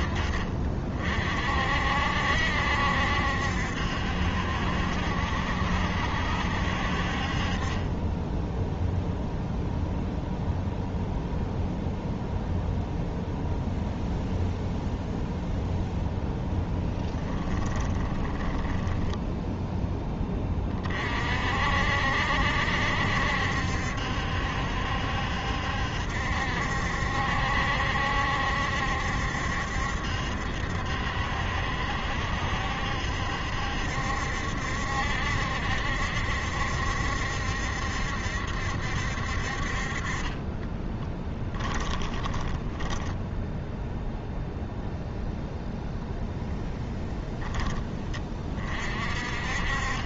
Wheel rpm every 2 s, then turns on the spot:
50, 70, 70, 50, 0, 0, 0, 0, 10, 10, 40, 70, 70, 70, 70, 70, 70, 70, 70, 70, 20, 10, 0, 10, 40.
16-20 40-44